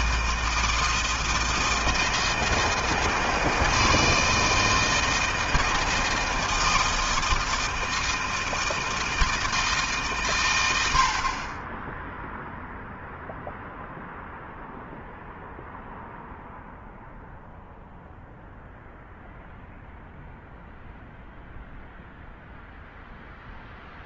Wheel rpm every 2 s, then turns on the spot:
160, 160, 160, 160, 160, 60, 0, 0, 0, 0, 0, 0.
none